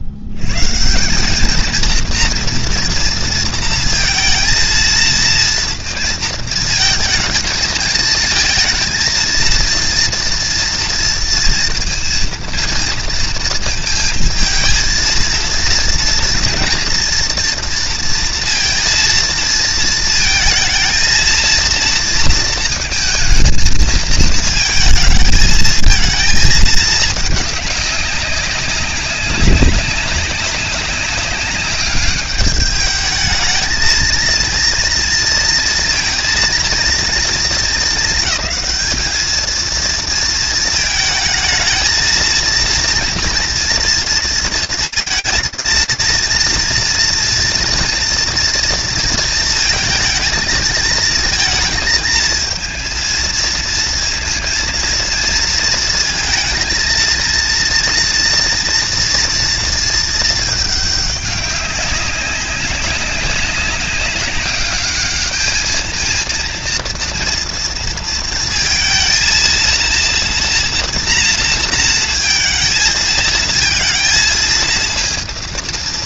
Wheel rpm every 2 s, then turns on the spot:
100, 230, 230, 220, 220, 230, 230, 230, 230, 230, 220, 230, 220, 220, 200, 200, 210, 230, 230, 220, 220, 230, 230, 230, 230, 220, 230, 230, 230, 230, 210, 190, 210, 230, 230, 230, 220, 230.
none